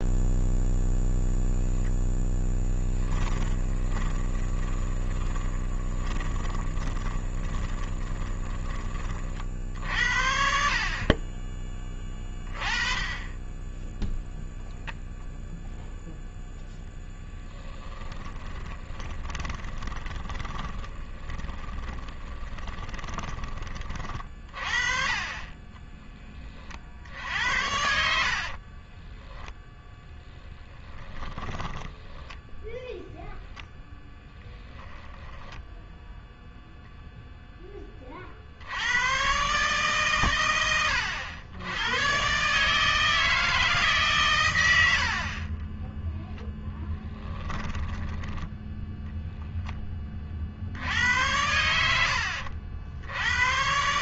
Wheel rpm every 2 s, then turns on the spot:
0, 10, 20, 20, 30, 40, 30, 0, 10, 20, 20, 20, 40, 60, 20, 20, 0, 20, 0, 90, 100, 150, 80, 10, 0, 80, 80.
2-8 18-26 28-32 34-36 46-48